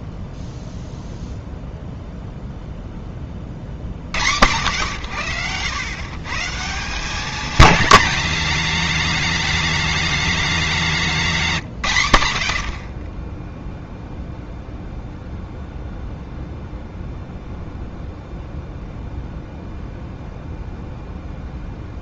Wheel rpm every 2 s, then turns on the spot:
0, 0, 100, 170, 220, 200, 70, 0, 0, 0, 0.
none